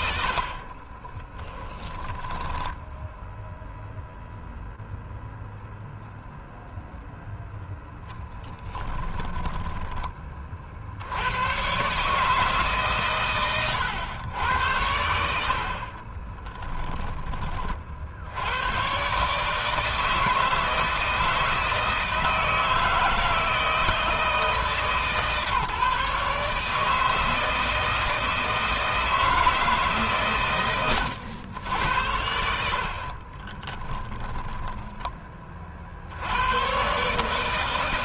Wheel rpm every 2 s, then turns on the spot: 40, 10, 0, 0, 10, 60, 140, 80, 10, 120, 160, 160, 150, 150, 160, 100, 60, 30, 130.
0-4 8-10 32-34